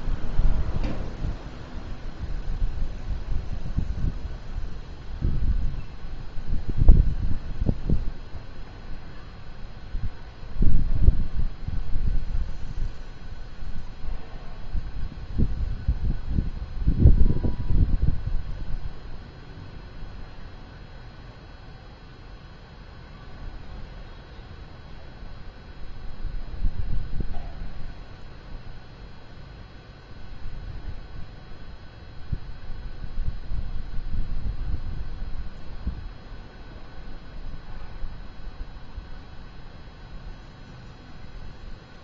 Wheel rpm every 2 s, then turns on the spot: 0, 0, 0, 0, 0, 0, 0, 0, 0, 0, 0, 0, 0, 0, 0, 0, 0, 0, 0, 0, 0.
none